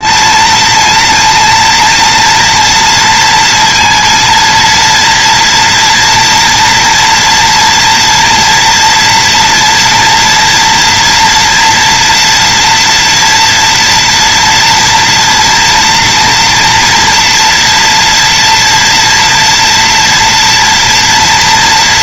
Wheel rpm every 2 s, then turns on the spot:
220, 230, 230, 230, 230, 230, 240, 230, 230, 230, 230.
none